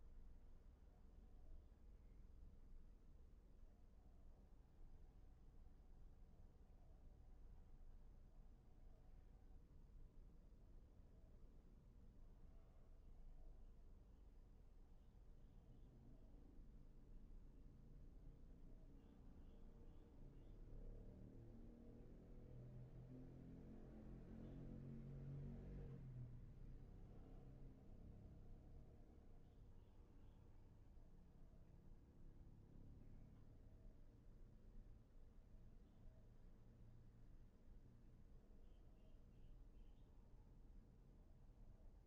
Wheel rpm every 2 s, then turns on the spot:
0, 0, 0, 0, 0, 0, 0, 0, 0, 0, 0, 0, 0, 0, 0, 0, 0, 0, 0, 0, 0.
none